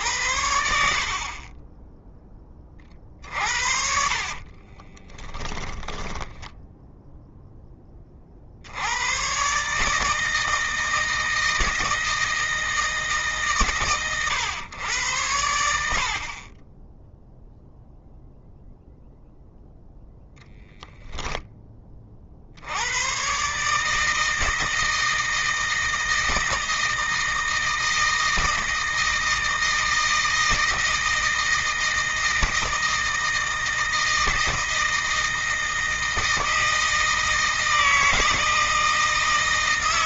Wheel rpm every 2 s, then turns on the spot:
70, 30, 20, 0, 90, 160, 150, 100, 10, 0, 0, 100, 160, 160, 160, 160, 160, 160, 160, 160.
4-6